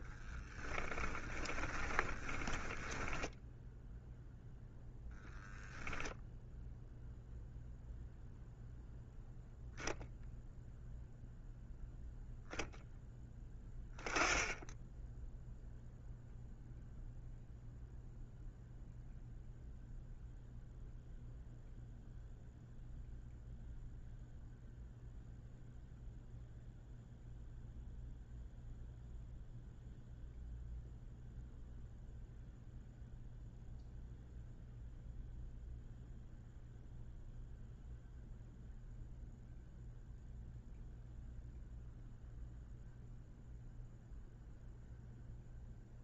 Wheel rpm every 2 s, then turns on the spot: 10, 10, 0, 0, 0, 0, 0, 10, 0, 0, 0, 0, 0, 0, 0, 0, 0, 0, 0, 0, 0, 0, 0.
0-4